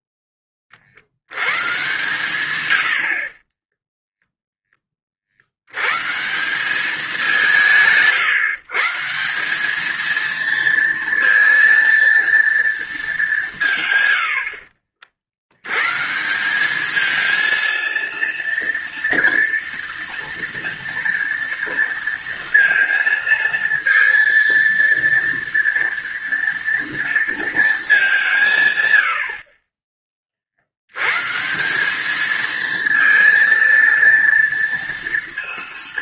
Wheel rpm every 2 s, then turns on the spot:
30, 100, 10, 180, 150, 230, 230, 60, 190, 230, 230, 230, 230, 230, 140, 60, 220, 230.
2-4